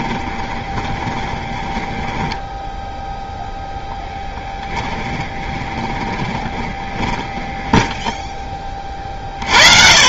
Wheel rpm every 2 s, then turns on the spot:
20, 10, 30, 20, 20.
0-8